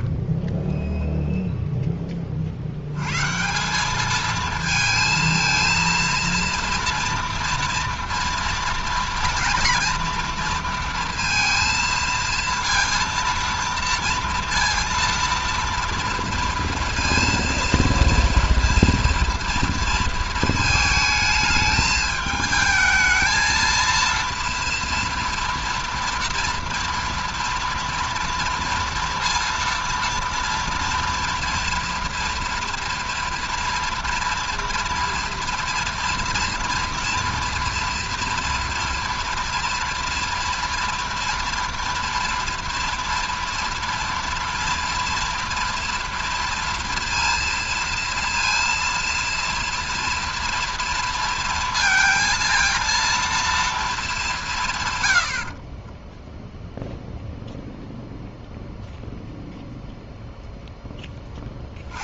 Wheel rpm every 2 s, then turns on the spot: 10, 70, 220, 230, 240, 230, 230, 230, 230, 230, 220, 220, 230, 230, 230, 230, 230, 230, 230, 230, 240, 230, 230, 230, 230, 230, 230, 150, 0, 0, 0.
0-2